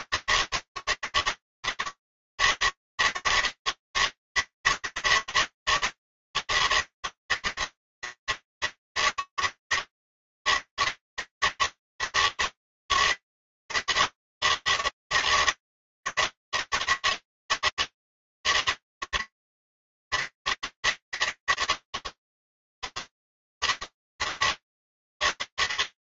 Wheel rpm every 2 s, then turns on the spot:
160, 160, 160, 160, 150, 160, 150, 160, 160, 150, 160, 160, 150.
none